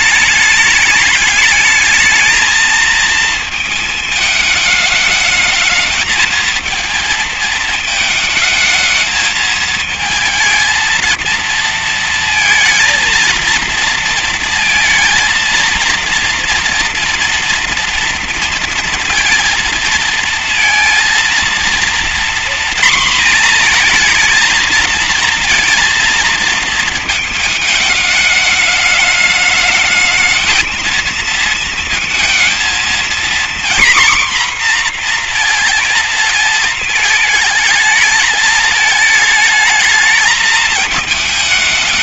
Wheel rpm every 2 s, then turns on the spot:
210, 230, 220, 220, 220, 220, 230, 230, 230, 230, 230, 240, 230, 220, 210, 220, 230, 240, 220, 220, 220.
none